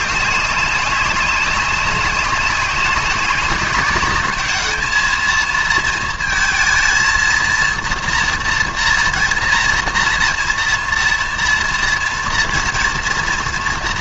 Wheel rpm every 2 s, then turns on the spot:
200, 200, 210, 230, 230, 230, 230.
none